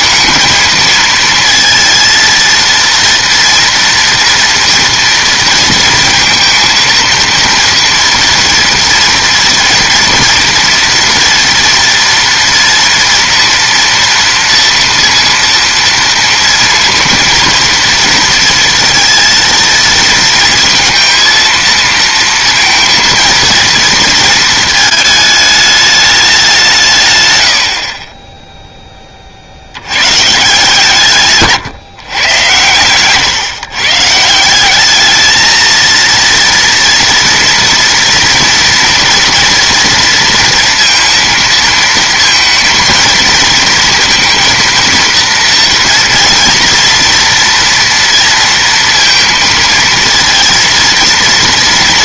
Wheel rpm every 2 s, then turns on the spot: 230, 230, 230, 230, 230, 230, 230, 230, 230, 230, 230, 230, 220, 180, 10, 150, 120, 180, 240, 240, 230, 230, 230, 230, 230, 230.
none